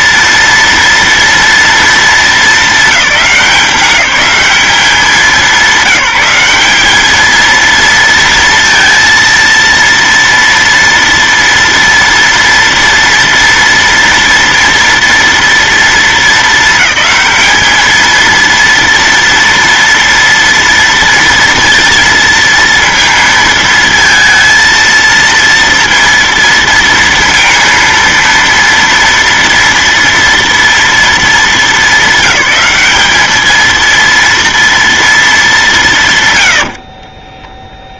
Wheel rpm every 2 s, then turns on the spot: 230, 200, 200, 210, 230, 230, 230, 230, 220, 230, 230, 230, 230, 230, 230, 230, 220, 230, 40.
36-38